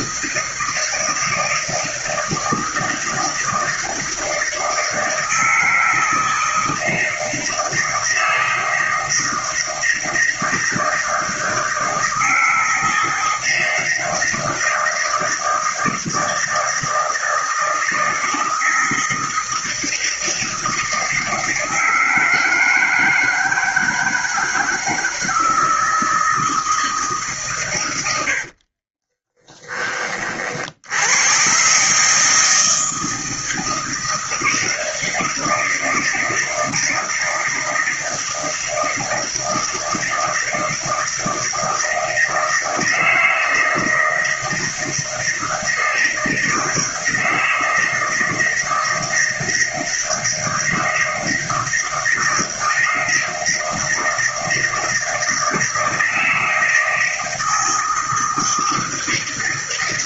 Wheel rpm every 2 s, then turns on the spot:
160, 160, 160, 160, 160, 160, 160, 160, 160, 160, 160, 160, 160, 160, 60, 60, 160, 160, 160, 160, 160, 160, 160, 160, 160, 160, 160, 160, 160, 160.
28-30